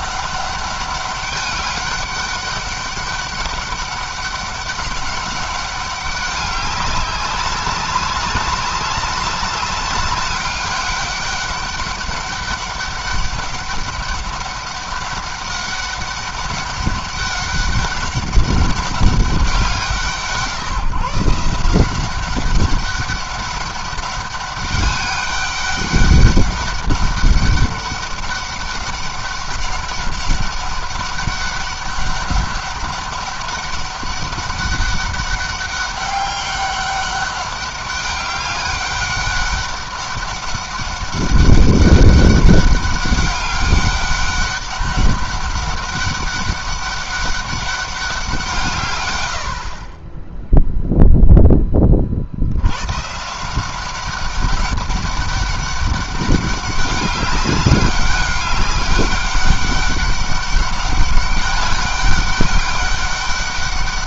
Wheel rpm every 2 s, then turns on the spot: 200, 200, 200, 200, 200, 200, 200, 200, 200, 200, 160, 190, 200, 200, 200, 200, 200, 200, 200, 200, 200, 200, 200, 200, 140, 0, 110, 200, 200, 200, 200, 200.
none